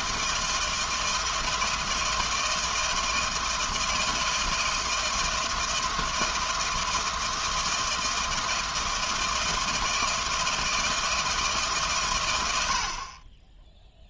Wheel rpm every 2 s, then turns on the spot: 160, 160, 160, 160, 160, 160, 60.
none